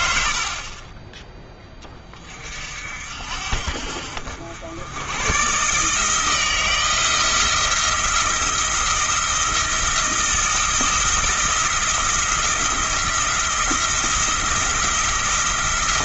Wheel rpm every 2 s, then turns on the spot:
30, 60, 100, 160, 170, 170, 170, 170.
none